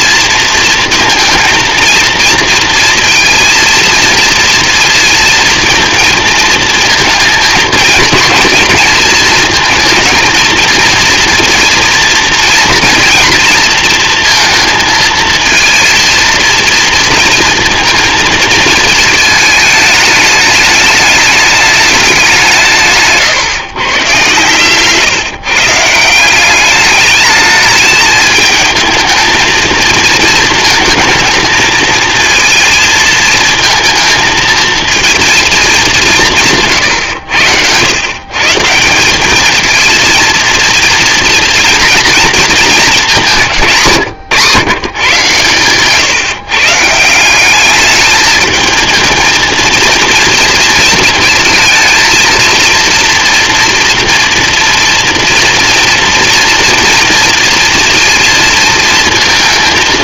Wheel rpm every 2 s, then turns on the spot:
230, 230, 230, 230, 220, 230, 230, 230, 230, 230, 210, 180, 130, 190, 220, 220, 230, 230, 160, 150, 230, 220, 130, 150, 220, 230, 230, 230, 230, 230.
none